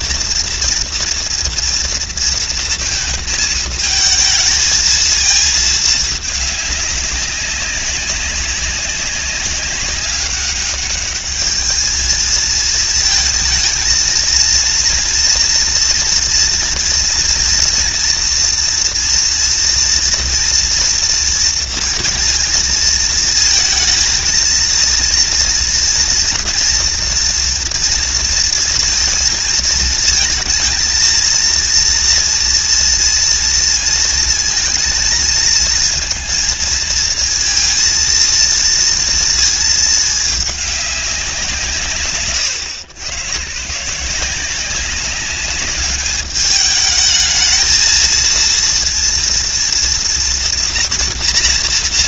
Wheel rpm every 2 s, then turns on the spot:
230, 230, 220, 200, 190, 210, 220, 230, 230, 230, 240, 230, 230, 230, 230, 230, 230, 230, 220, 230, 200, 120, 190, 210, 230, 230.
none